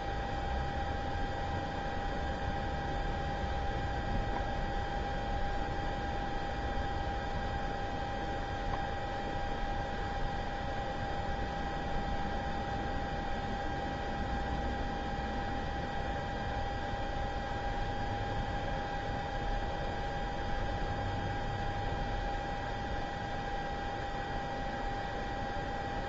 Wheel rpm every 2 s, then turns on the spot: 0, 0, 0, 0, 0, 0, 0, 0, 0, 0, 0, 0, 0.
none